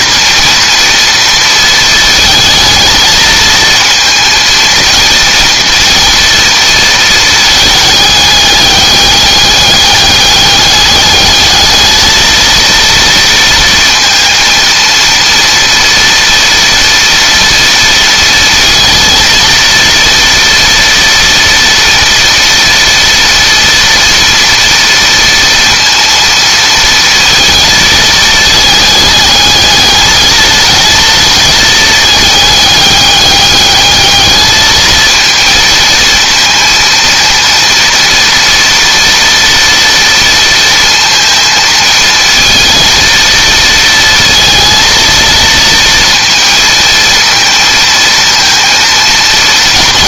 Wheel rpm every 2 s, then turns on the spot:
230, 220, 230, 230, 200, 210, 230, 230, 230, 230, 230, 230, 230, 230, 220, 220, 210, 220, 230, 230, 230, 230, 230, 230, 230.
none